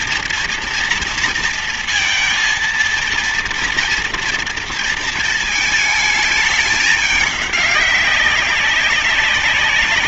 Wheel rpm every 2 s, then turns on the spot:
240, 230, 230, 220, 200.
none